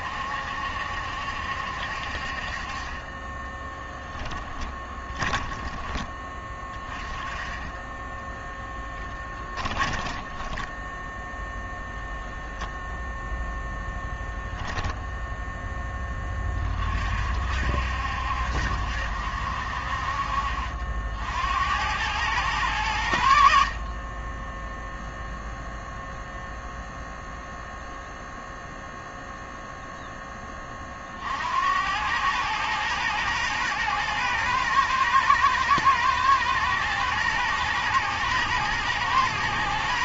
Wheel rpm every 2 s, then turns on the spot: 70, 30, 20, 20, 10, 0, 0, 10, 40, 60, 60, 90, 0, 0, 0, 50, 110, 110, 110, 120.
4-6 14-16